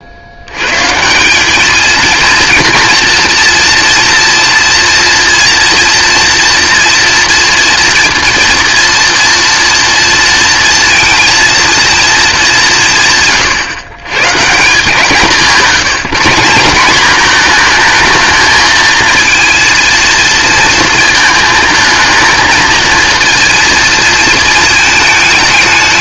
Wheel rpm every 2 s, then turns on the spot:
130, 230, 230, 230, 230, 230, 180, 160, 190, 220, 230, 230, 220.
none